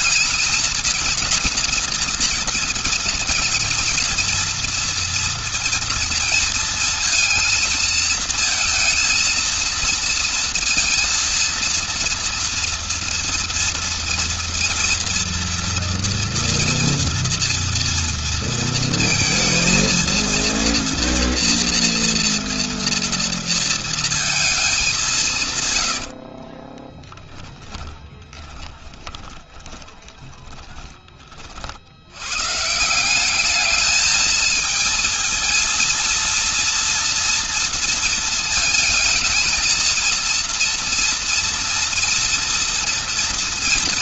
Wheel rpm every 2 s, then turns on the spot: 230, 230, 230, 230, 230, 230, 230, 230, 240, 230, 230, 230, 210, 20, 20, 20, 130, 220, 230, 220, 230, 230.
26-32